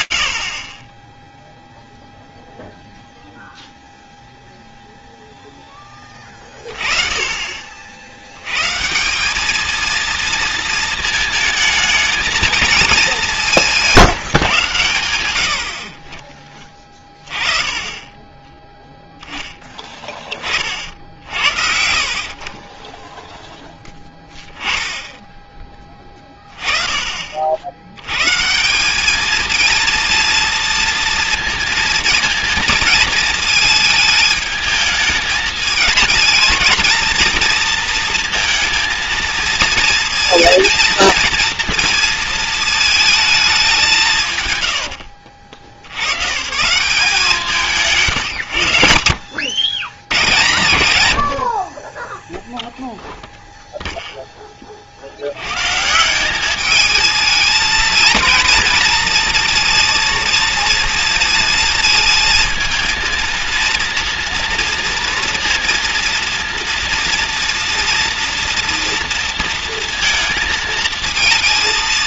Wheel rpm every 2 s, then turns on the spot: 90, 0, 0, 30, 200, 220, 200, 90, 20, 10, 60, 10, 20, 100, 230, 230, 220, 220, 230, 230, 230, 170, 90, 140, 90, 30, 0, 140, 230, 230, 230, 230, 230, 230, 230, 230.
46-52